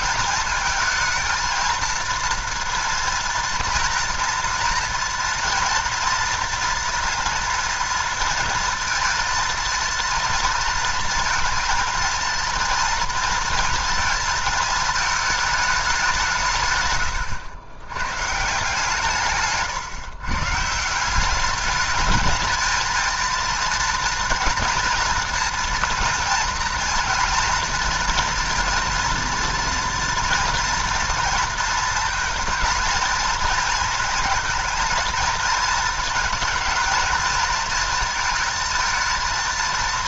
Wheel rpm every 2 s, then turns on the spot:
220, 230, 230, 240, 230, 230, 230, 220, 120, 160, 150, 220, 230, 230, 230, 230, 230, 220, 220, 220.
none